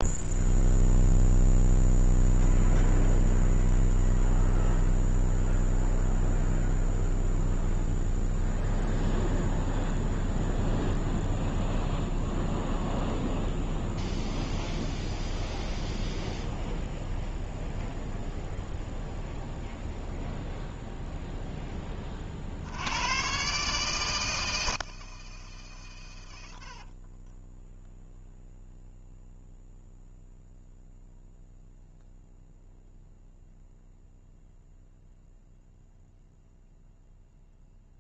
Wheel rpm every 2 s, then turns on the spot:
0, 0, 0, 0, 0, 0, 0, 0, 0, 0, 0, 100, 160, 40, 0, 0, 0, 0, 0.
26-28